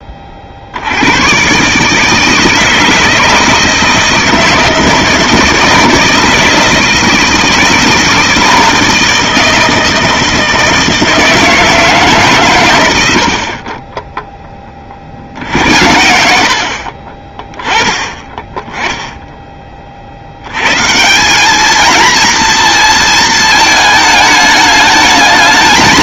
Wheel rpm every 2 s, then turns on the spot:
50, 160, 160, 160, 160, 160, 130, 10, 70, 10, 90, 230, 220.
none